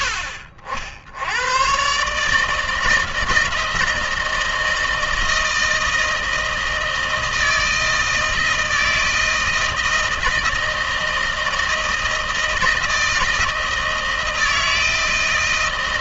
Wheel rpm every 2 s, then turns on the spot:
70, 150, 160, 160, 160, 160, 160, 160.
none